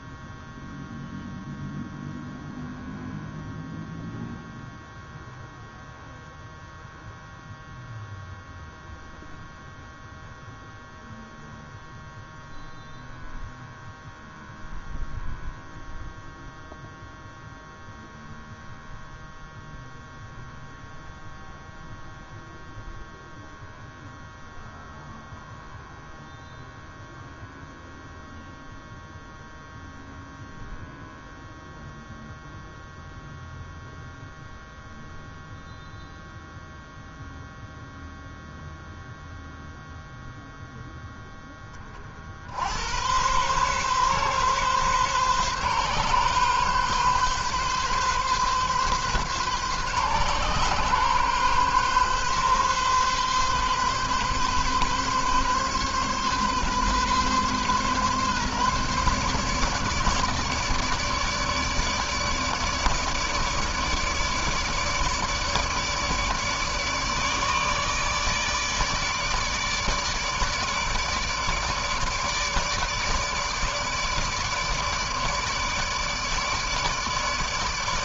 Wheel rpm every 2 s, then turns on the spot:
0, 0, 0, 0, 0, 0, 0, 0, 0, 0, 0, 0, 0, 0, 0, 0, 0, 0, 0, 0, 0, 60, 130, 140, 130, 130, 130, 130, 130, 140, 150, 150, 150, 150, 150, 150, 150, 150, 150.
none